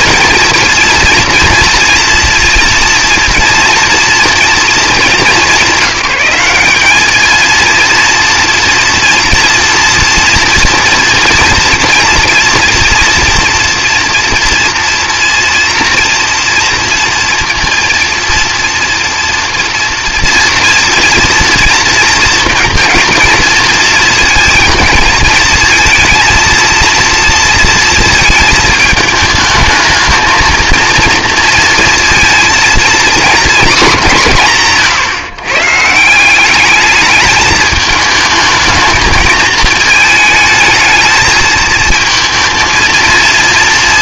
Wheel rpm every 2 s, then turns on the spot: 230, 230, 230, 210, 230, 230, 230, 230, 230, 230, 230, 230, 220, 230, 220, 230, 230, 160, 200, 220, 220, 230.
none